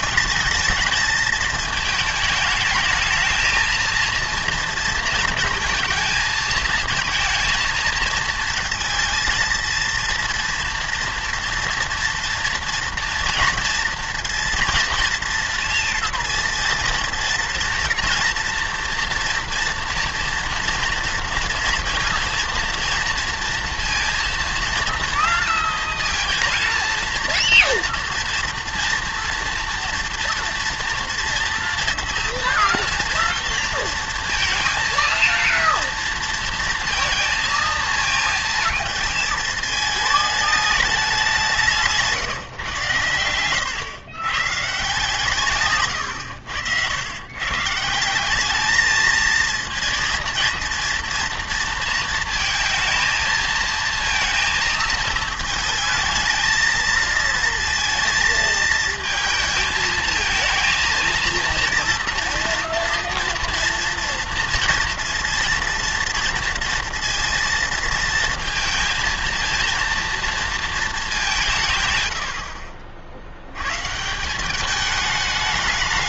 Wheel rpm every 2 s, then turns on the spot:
220, 220, 230, 220, 230, 240, 230, 230, 230, 230, 230, 230, 230, 230, 230, 230, 230, 230, 230, 230, 210, 130, 140, 90, 210, 230, 230, 230, 230, 220, 230, 230, 230, 230, 230, 220, 50, 200.
none